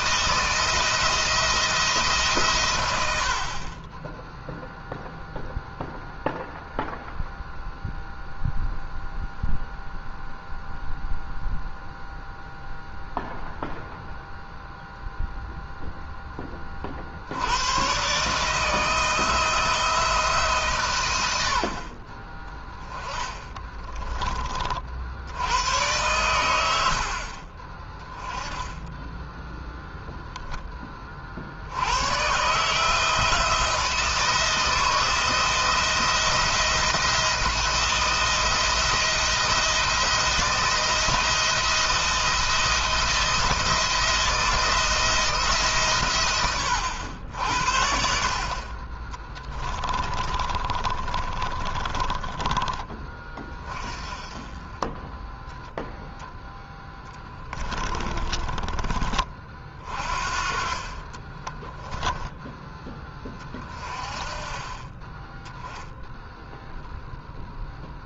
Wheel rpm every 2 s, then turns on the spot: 170, 110, 0, 0, 0, 0, 0, 0, 40, 160, 130, 20, 50, 80, 10, 20, 160, 160, 170, 170, 170, 170, 170, 110, 40, 30, 20, 20, 10, 20, 30, 10, 20, 0.
28-30 48-52 56-58 60-62